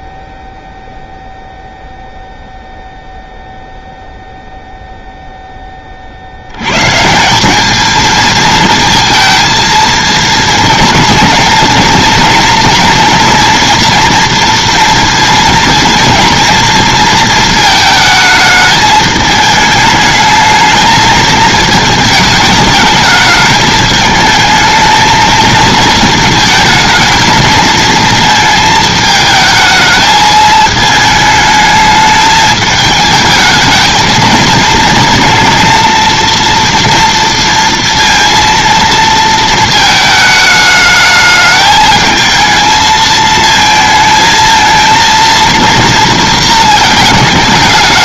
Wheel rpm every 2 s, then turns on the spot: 0, 0, 0, 120, 220, 230, 230, 230, 230, 220, 220, 210, 220, 220, 220, 220, 210, 230, 230, 230, 210, 220, 230, 230.
none